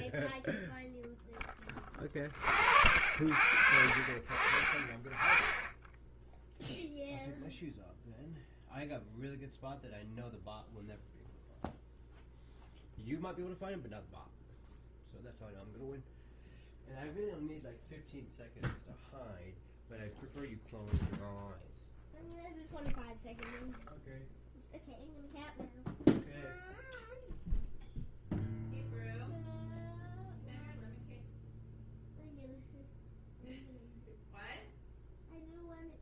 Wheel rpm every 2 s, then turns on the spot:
0, 50, 20, 0, 0, 0, 0, 0, 0, 0, 0, 0, 0, 0, 0, 0, 0, 0.
none